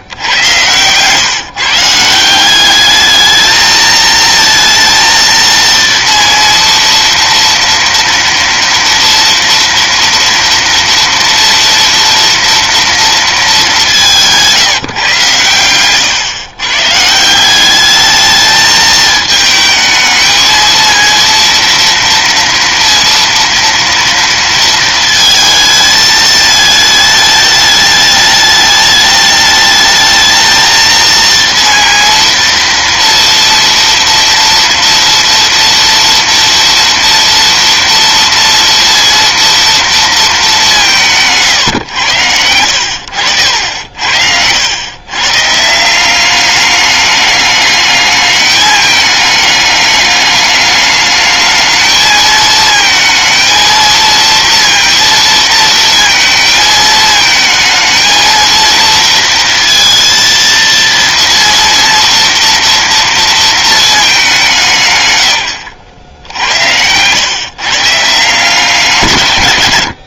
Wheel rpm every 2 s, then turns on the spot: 120, 190, 230, 230, 230, 230, 240, 170, 120, 220, 230, 230, 230, 220, 210, 220, 230, 230, 230, 230, 200, 80, 90, 200, 210, 210, 220, 230, 220, 230, 230, 230, 180, 90, 160.
none